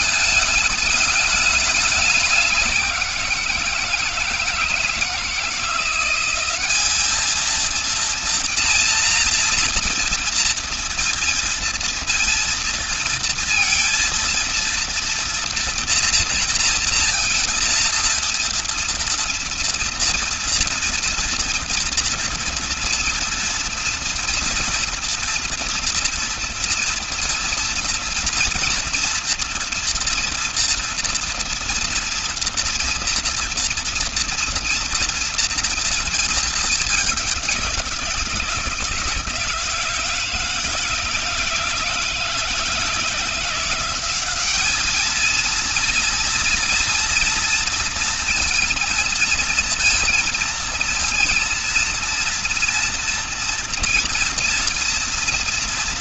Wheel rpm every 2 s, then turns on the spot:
210, 190, 160, 200, 230, 230, 230, 230, 240, 230, 230, 230, 230, 230, 230, 230, 230, 230, 220, 170, 160, 160, 210, 240, 240, 230, 230, 240.
none